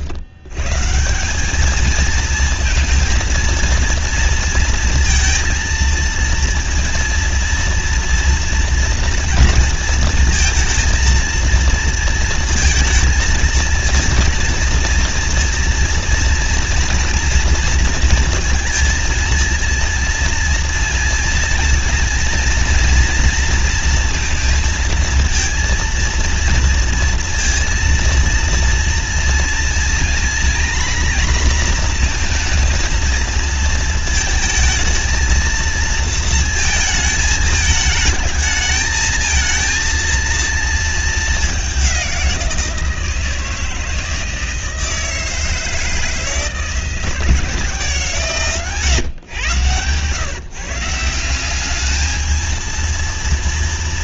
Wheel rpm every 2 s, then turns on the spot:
130, 230, 230, 230, 230, 220, 230, 230, 230, 220, 230, 230, 230, 230, 230, 240, 230, 220, 220, 220, 230, 170, 160, 160, 130, 150, 230.
none